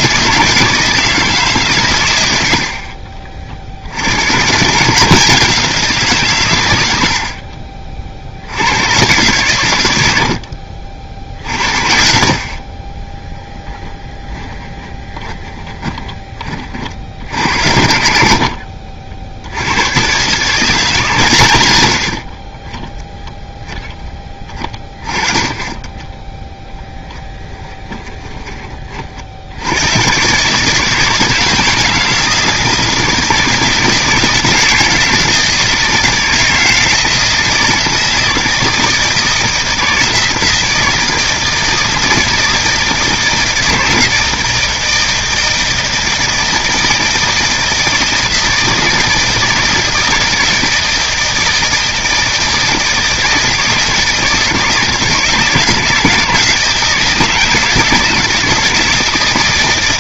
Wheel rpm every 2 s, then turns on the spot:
160, 60, 150, 100, 100, 60, 40, 10, 50, 60, 150, 10, 20, 10, 30, 150, 160, 160, 160, 160, 160, 160, 160, 160, 160, 160, 160, 160, 160, 160.
14-16 18-20